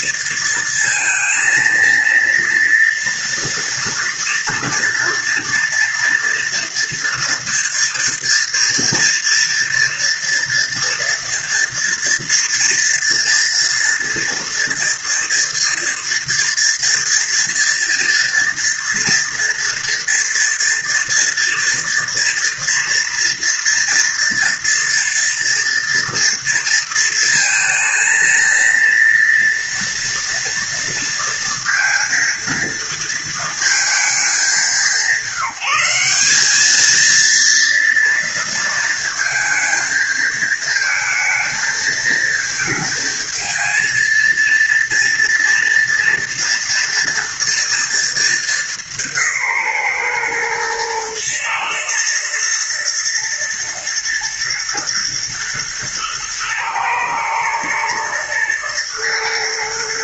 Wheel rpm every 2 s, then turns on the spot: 230, 230, 230, 230, 230, 230, 240, 230, 240, 230, 230, 230, 230, 230, 230, 230, 230, 190, 200, 230, 220, 220, 230, 230, 200, 120, 110, 110, 120, 110.
none